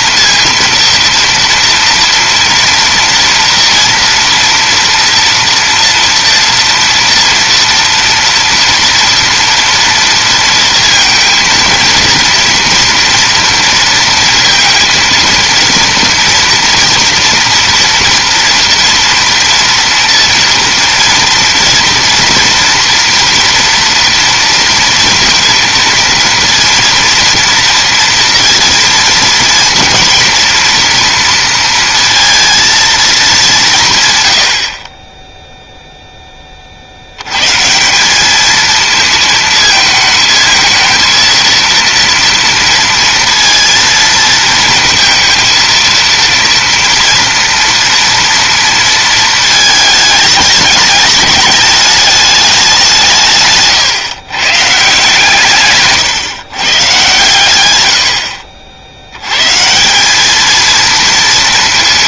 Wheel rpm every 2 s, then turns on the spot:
230, 230, 230, 230, 230, 230, 230, 230, 230, 230, 230, 230, 230, 230, 230, 230, 230, 40, 60, 220, 220, 230, 230, 240, 230, 220, 190, 150, 130, 70, 230.
none